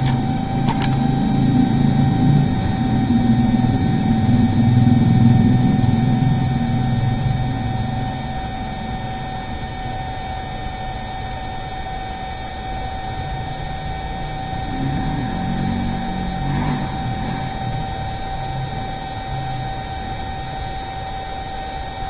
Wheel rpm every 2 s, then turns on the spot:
0, 0, 0, 0, 0, 0, 0, 0, 0, 0, 0.
none